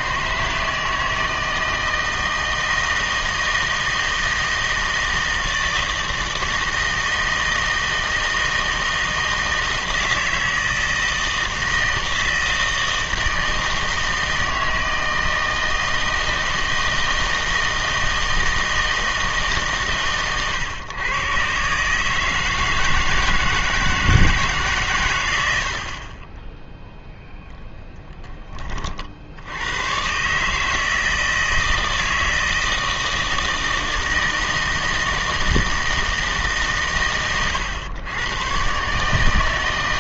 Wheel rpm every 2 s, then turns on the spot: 160, 160, 160, 160, 160, 160, 160, 160, 160, 160, 120, 160, 140, 0, 30, 150, 160, 160, 140, 130.
none